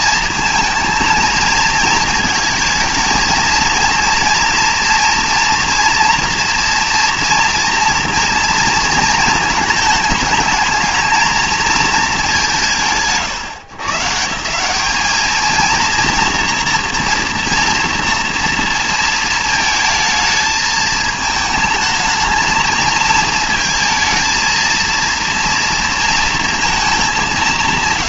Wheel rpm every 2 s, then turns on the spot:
220, 220, 240, 230, 220, 220, 140, 190, 230, 230, 220, 220, 230, 230.
none